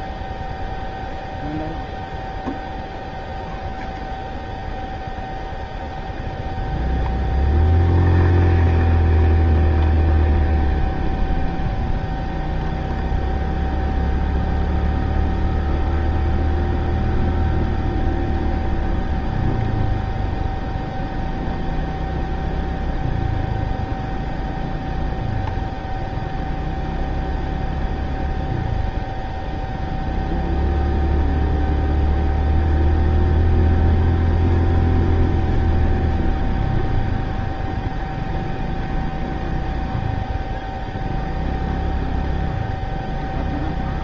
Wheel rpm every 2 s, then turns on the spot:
0, 0, 0, 0, 0, 0, 0, 0, 0, 0, 0, 0, 0, 0, 0, 0, 0, 0, 0, 0, 0, 0.
none